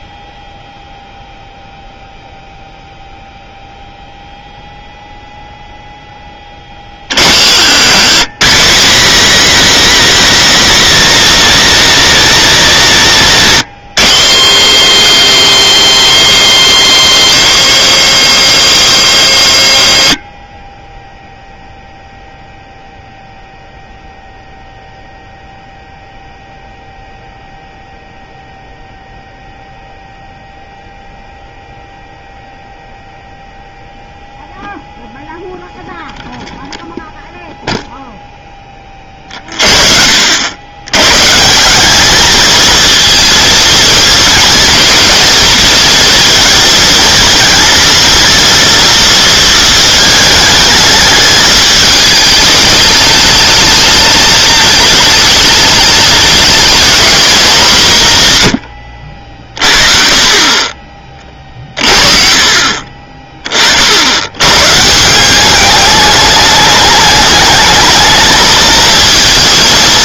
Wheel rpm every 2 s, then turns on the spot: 0, 0, 0, 40, 130, 120, 110, 130, 140, 140, 30, 0, 0, 0, 0, 0, 0, 0, 0, 20, 90, 220, 210, 230, 230, 210, 210, 210, 220, 110, 30, 40, 130, 210, 230.
none